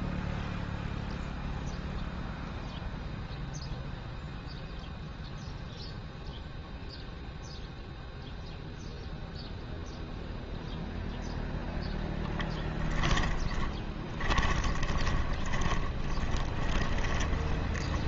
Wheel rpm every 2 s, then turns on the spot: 0, 0, 0, 0, 0, 0, 10, 20, 30.
12-18